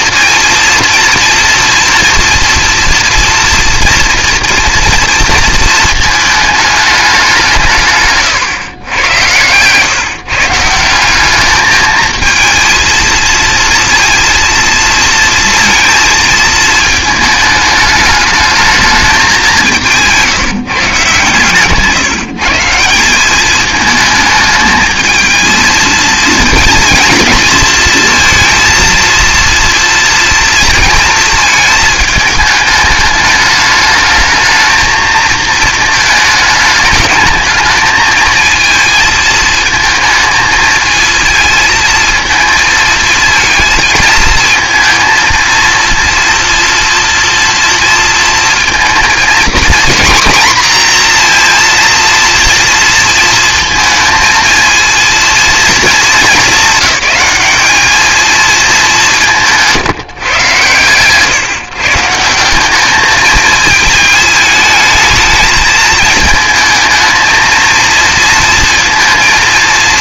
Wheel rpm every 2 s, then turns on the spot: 230, 240, 230, 220, 120, 160, 220, 230, 220, 210, 160, 160, 220, 230, 230, 230, 210, 220, 210, 220, 220, 230, 230, 230, 220, 240, 230, 230, 220, 210, 130, 200, 220, 220, 230.
8-10